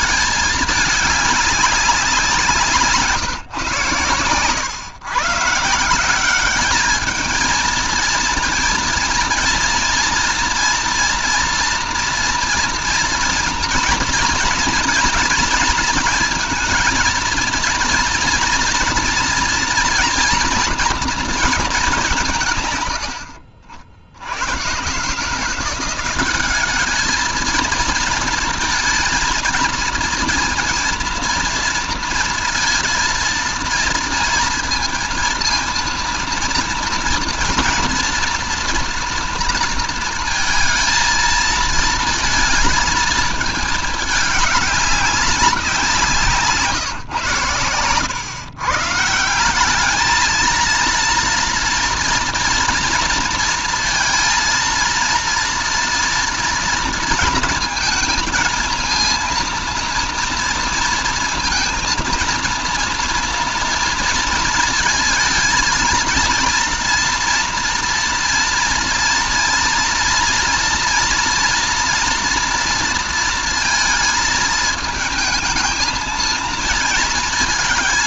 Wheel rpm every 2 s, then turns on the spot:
200, 150, 140, 210, 230, 230, 230, 230, 220, 230, 230, 90, 150, 210, 230, 230, 230, 230, 230, 230, 230, 220, 200, 120, 140, 230, 230, 230, 230, 230, 230, 230, 230, 230, 230, 230, 230, 220, 220.
none